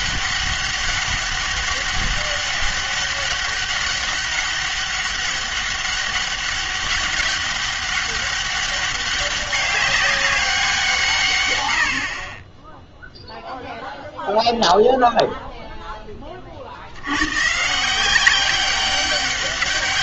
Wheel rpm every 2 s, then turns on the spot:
200, 200, 200, 200, 200, 180, 10, 0, 60, 200.
none